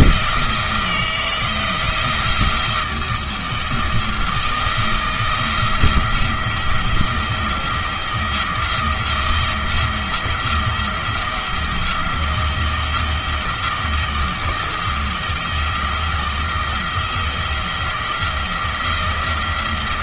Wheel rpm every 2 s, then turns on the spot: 160, 170, 170, 170, 170, 170, 170, 170, 170, 170.
none